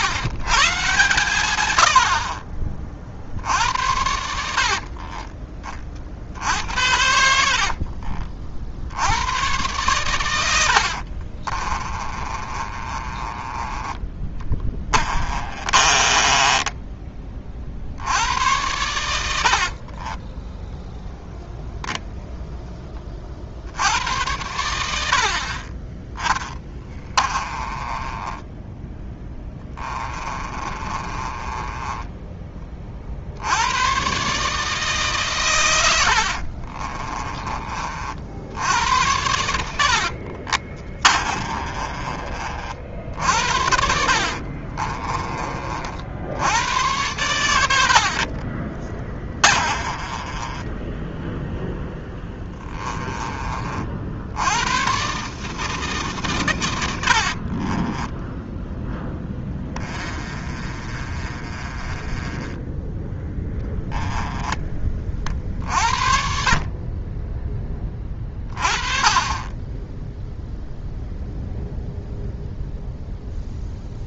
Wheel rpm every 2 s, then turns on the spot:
130, 30, 60, 70, 70, 70, 30, 20, 20, 100, 20, 20, 90, 20, 10, 20, 30, 150, 40, 80, 30, 50, 40, 100, 40, 10, 10, 110, 100, 20, 30, 10, 30, 30, 30, 0, 0.
4-8 10-18 26-32 36-38 40-42 44-46 48-52 58-62